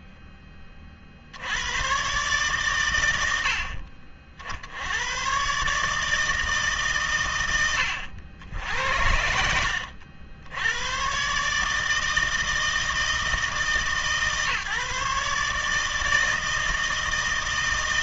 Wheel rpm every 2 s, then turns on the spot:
10, 120, 70, 140, 80, 90, 160, 140, 160.
8-10